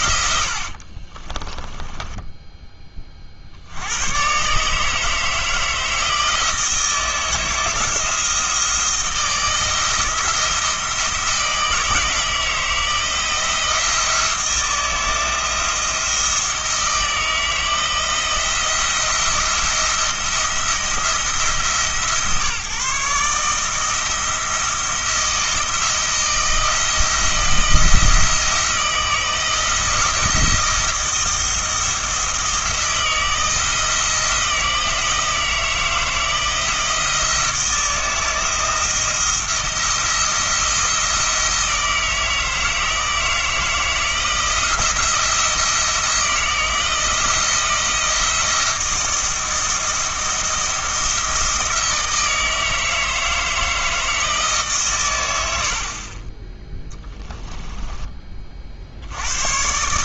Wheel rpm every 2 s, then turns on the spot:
50, 10, 150, 160, 160, 160, 160, 170, 170, 170, 170, 140, 170, 160, 170, 170, 170, 170, 160, 170, 170, 160, 170, 170, 170, 170, 160, 130, 10, 50.
0-2 56-58